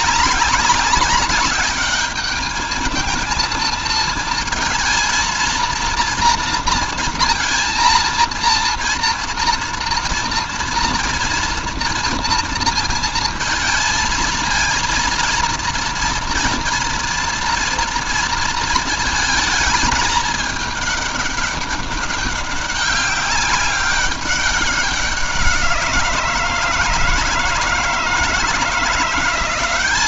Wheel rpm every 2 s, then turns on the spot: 200, 220, 230, 230, 230, 230, 230, 220, 230, 220, 210, 200, 200, 160, 160.
none